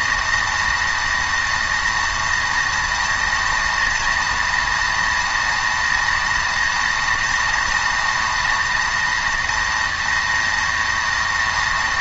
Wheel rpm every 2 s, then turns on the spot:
230, 230, 230, 240, 240, 230.
none